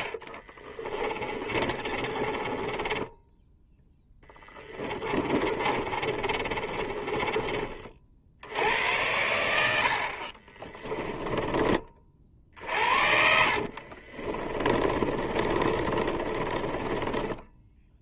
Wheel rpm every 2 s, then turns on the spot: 30, 10, 20, 30, 80, 20, 70, 30, 30.
0-8 10-18